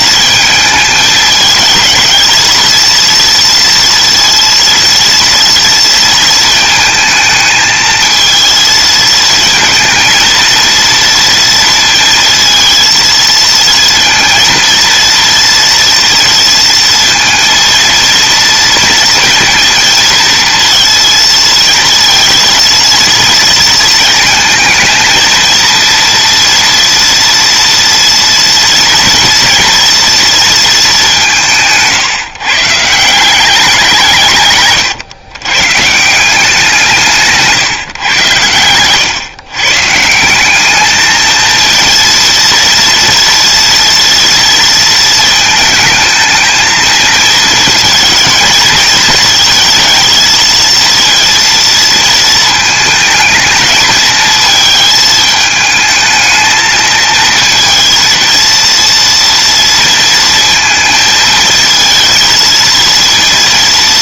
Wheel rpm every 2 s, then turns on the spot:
210, 230, 230, 220, 230, 230, 220, 230, 230, 230, 230, 230, 230, 230, 230, 190, 170, 120, 160, 120, 220, 230, 220, 220, 220, 230, 220, 220, 220, 230, 220, 220.
none